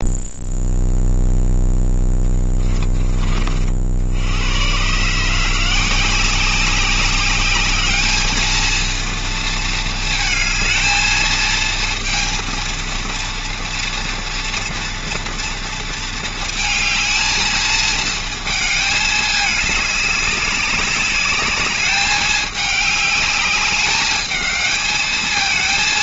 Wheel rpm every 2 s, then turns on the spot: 0, 20, 150, 200, 230, 220, 230, 230, 220, 210, 200, 210, 220.
none